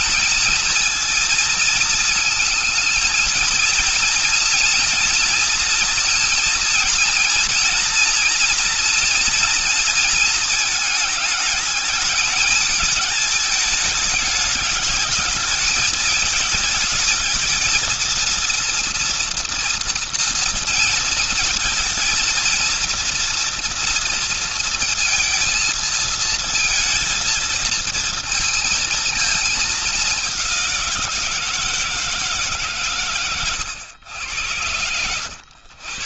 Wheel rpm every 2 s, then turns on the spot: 230, 230, 230, 240, 230, 220, 210, 210, 220, 230, 230, 230, 230, 220, 230, 200, 150, 100.
none